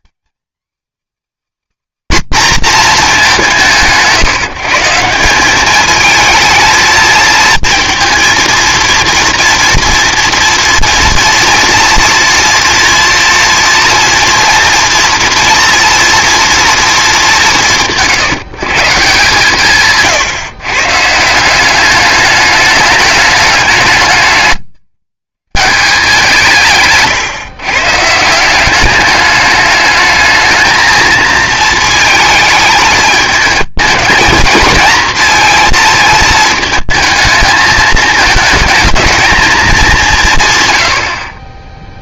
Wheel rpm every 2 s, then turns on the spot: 280, 260, 160, 230, 230, 230, 230, 230, 230, 150, 130, 210, 140, 170, 180, 220, 220, 220, 220, 220, 120.
none